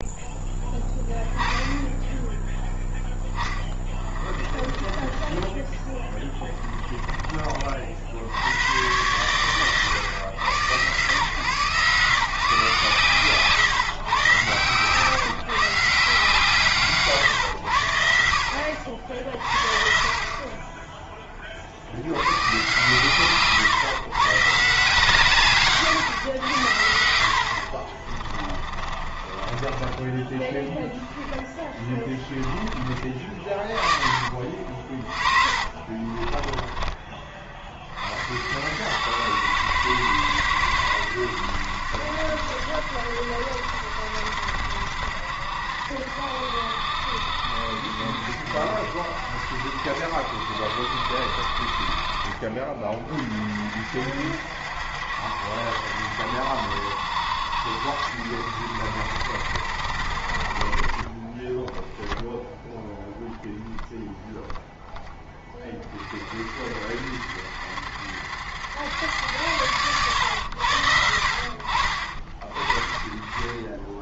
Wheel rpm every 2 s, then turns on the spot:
0, 10, 20, 20, 100, 120, 140, 130, 150, 70, 20, 120, 140, 90, 30, 10, 20, 40, 20, 80, 100, 60, 60, 60, 60, 60, 40, 70, 70, 70, 40, 0, 0, 50, 90, 100, 30.
4-8 28-32 34-38